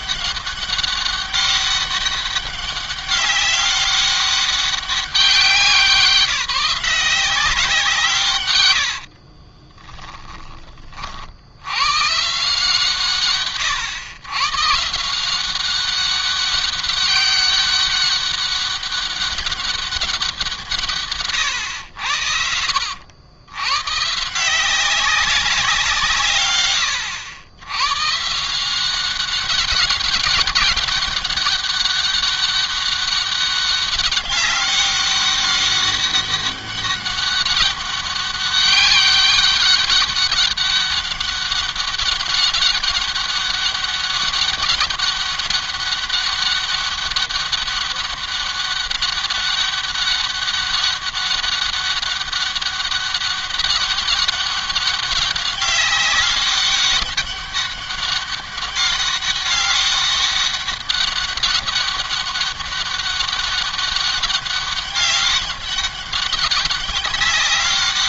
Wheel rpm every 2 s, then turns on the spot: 200, 200, 200, 180, 120, 20, 150, 130, 200, 200, 170, 80, 170, 130, 150, 190, 200, 200, 200, 200, 200, 200, 200, 200, 200, 200, 200, 200, 200, 200, 200, 200, 200, 190.
8-10 22-24